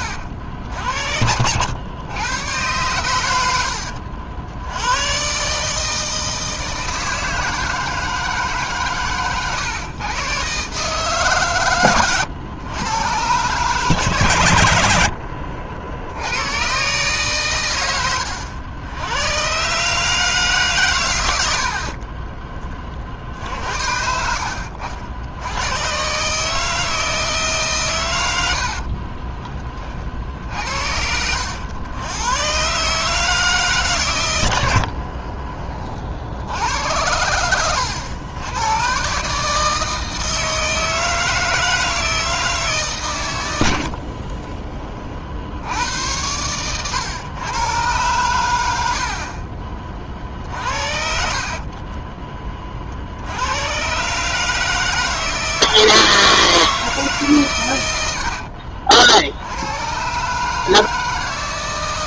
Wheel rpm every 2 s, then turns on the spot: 70, 110, 80, 160, 140, 140, 110, 100, 120, 90, 140, 30, 60, 160, 70, 60, 130, 90, 80, 110, 160, 150, 30, 110, 100, 60, 30, 160, 160, 60, 150.
28-30 44-46 50-52 58-60